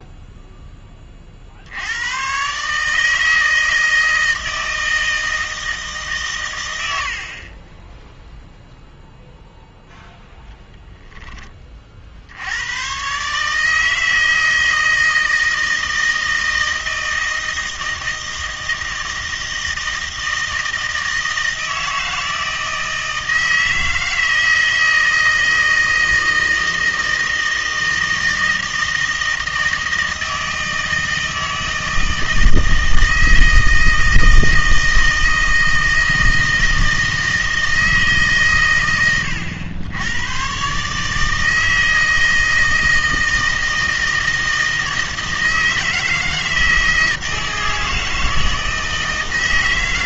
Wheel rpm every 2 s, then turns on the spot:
10, 140, 160, 110, 0, 10, 100, 160, 160, 160, 160, 160, 160, 160, 160, 160, 160, 160, 160, 120, 140, 160, 160, 160, 160.
none